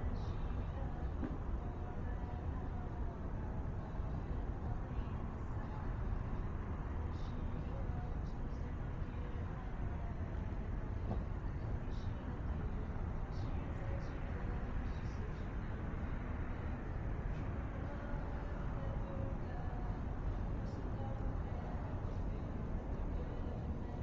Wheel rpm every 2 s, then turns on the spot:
0, 0, 0, 0, 0, 0, 0, 0, 0, 0, 0, 0.
none